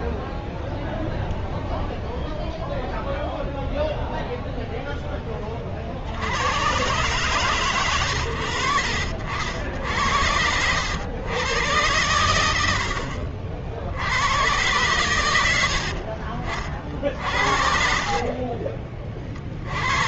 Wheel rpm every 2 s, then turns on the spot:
0, 0, 0, 90, 90, 70, 80, 100, 50, 40.
18-20